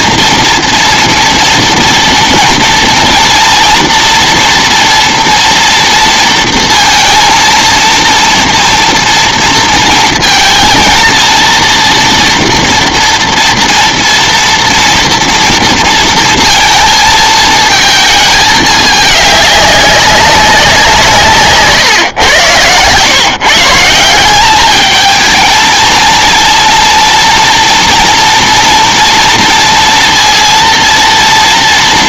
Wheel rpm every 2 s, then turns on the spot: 230, 230, 230, 230, 230, 230, 240, 230, 230, 220, 190, 110, 200, 230, 240, 230.
none